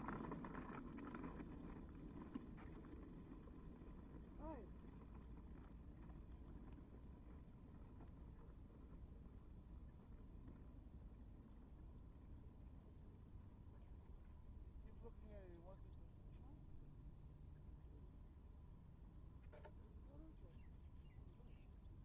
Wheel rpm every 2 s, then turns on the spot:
0, 0, 0, 0, 0, 0, 0, 0, 0, 0, 0.
none